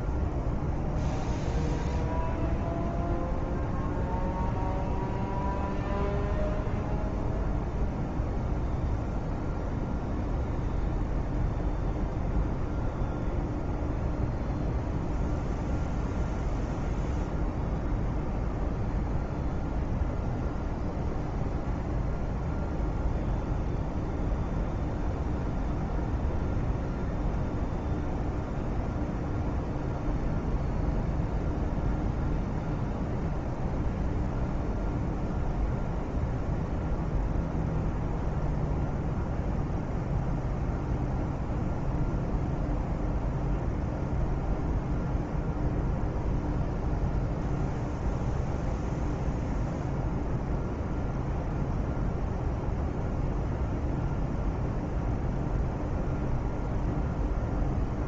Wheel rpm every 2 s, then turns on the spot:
0, 0, 0, 0, 0, 0, 0, 0, 0, 0, 0, 0, 0, 0, 0, 0, 0, 0, 0, 0, 0, 0, 0, 0, 0, 0, 0, 0, 0.
none